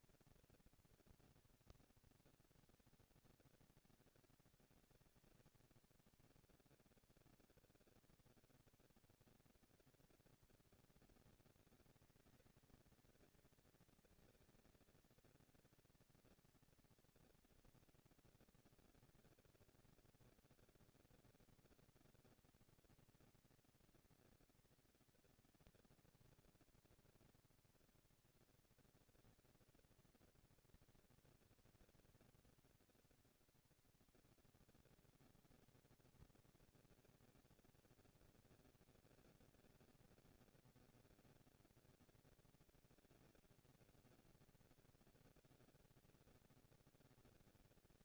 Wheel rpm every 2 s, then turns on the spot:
230, 200, 190, 200, 210, 230, 220, 230, 230, 230, 230, 230, 230, 230, 230, 230, 230, 230, 230, 230, 230, 230, 230, 220.
none